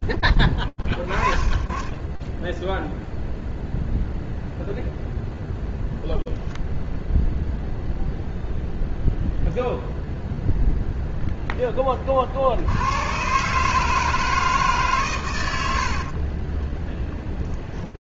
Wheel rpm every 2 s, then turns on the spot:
20, 0, 0, 0, 0, 10, 140, 100, 10.
none